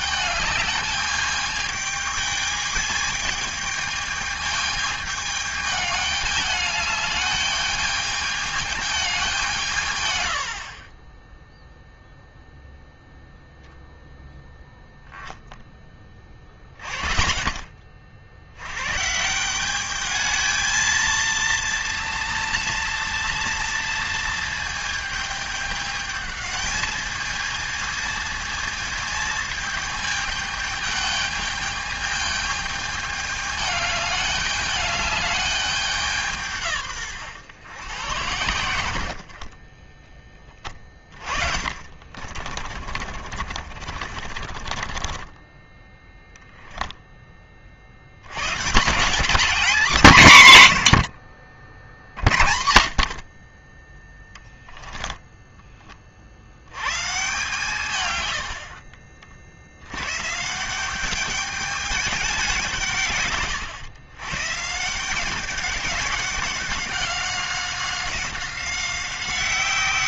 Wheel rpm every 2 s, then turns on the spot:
210, 210, 210, 210, 200, 30, 0, 0, 10, 110, 230, 230, 220, 220, 220, 210, 210, 210, 140, 80, 20, 40, 30, 0, 170, 120, 70, 20, 110, 70, 180, 160, 160, 190, 190.
40-46 54-56